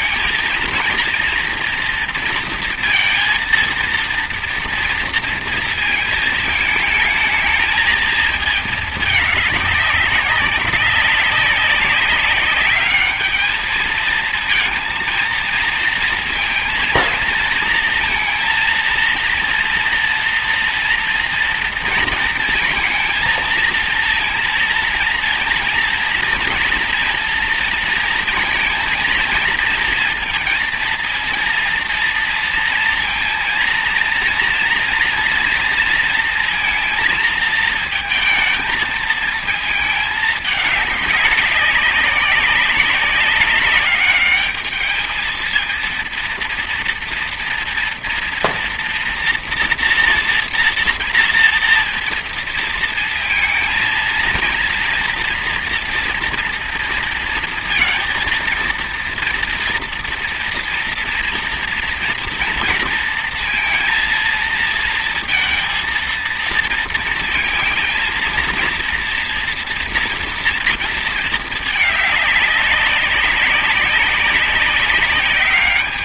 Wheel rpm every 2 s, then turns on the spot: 230, 230, 230, 220, 210, 200, 210, 230, 230, 230, 230, 230, 230, 230, 230, 230, 230, 230, 230, 220, 210, 200, 210, 230, 230, 230, 230, 230, 230, 230, 240, 230, 230, 220, 230, 230, 200, 190.
none